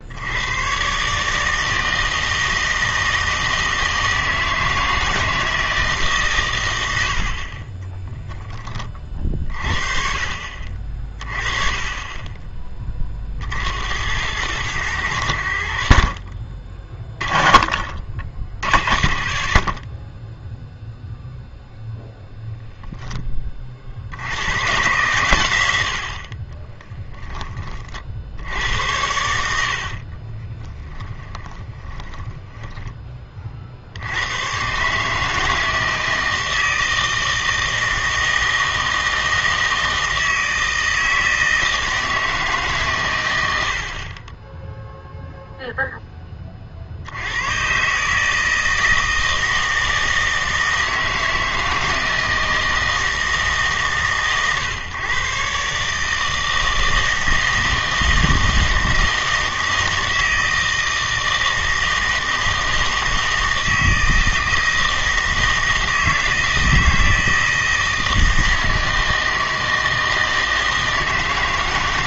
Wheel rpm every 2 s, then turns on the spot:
120, 160, 160, 110, 20, 40, 20, 100, 30, 60, 0, 0, 130, 20, 80, 30, 20, 130, 160, 160, 160, 140, 0, 40, 160, 160, 160, 130, 160, 160, 160, 160, 160, 160, 160, 160.
26-28 30-34